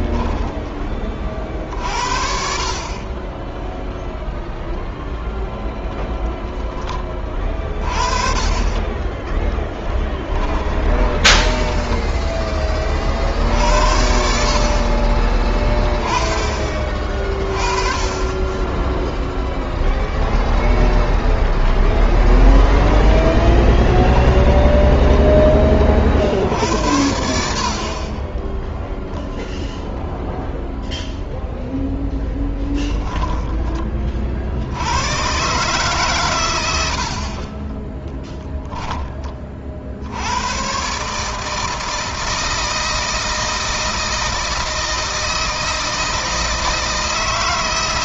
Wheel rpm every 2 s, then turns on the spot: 20, 30, 0, 20, 30, 20, 30, 40, 30, 10, 10, 10, 20, 70, 0, 0, 10, 80, 90, 20, 130, 160, 160, 160.
8-12 22-26 32-34